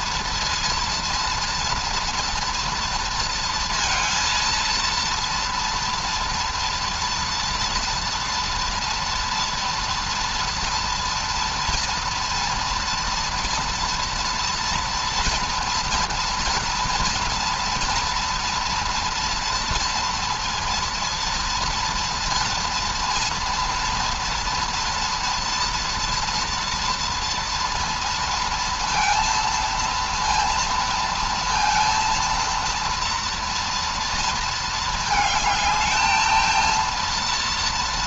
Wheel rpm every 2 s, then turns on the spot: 230, 230, 230, 230, 230, 230, 230, 230, 230, 240, 230, 230, 230, 230, 230, 230, 230, 220, 230.
none